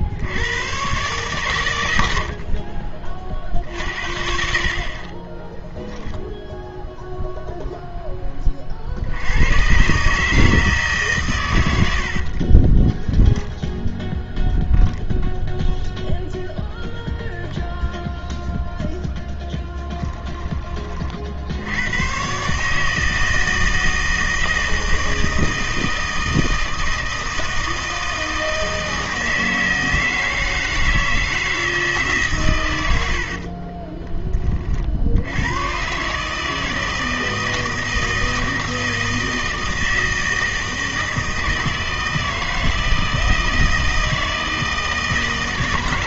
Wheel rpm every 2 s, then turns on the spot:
110, 40, 50, 0, 40, 150, 20, 10, 0, 0, 30, 150, 160, 160, 160, 160, 120, 50, 160, 160, 160, 160, 160.
12-14